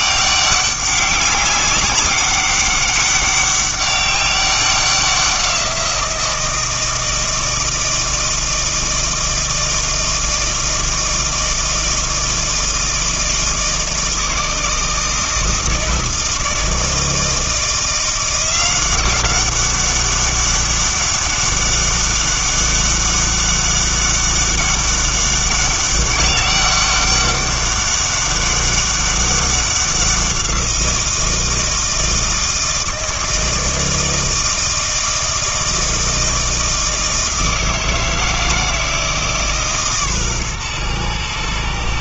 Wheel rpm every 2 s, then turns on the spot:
200, 200, 190, 170, 160, 160, 160, 160, 160, 180, 200, 200, 200, 200, 200, 180, 160, 160, 160, 160, 120.
none